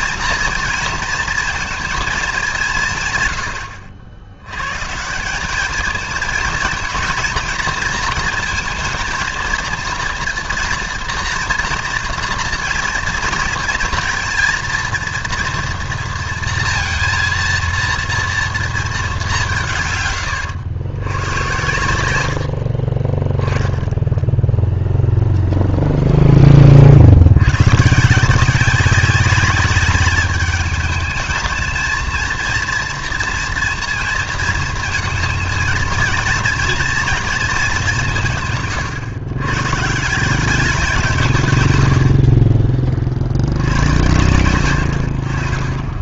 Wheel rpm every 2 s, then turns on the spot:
230, 180, 110, 230, 230, 230, 230, 230, 230, 230, 100, 60, 10, 10, 180, 210, 230, 230, 230, 150, 180, 40, 80.
none